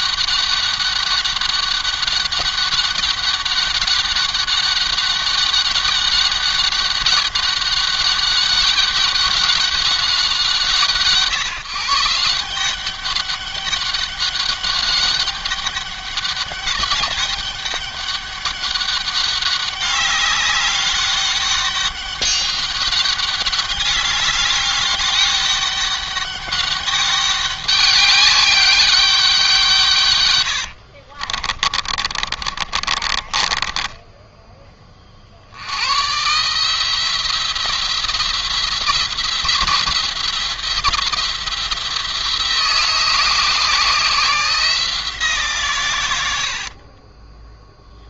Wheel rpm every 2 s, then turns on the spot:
200, 200, 200, 200, 200, 170, 180, 200, 200, 200, 200, 200, 200, 200, 200, 80, 40, 30, 160, 170, 180, 160, 170, 50.
30-34 46-48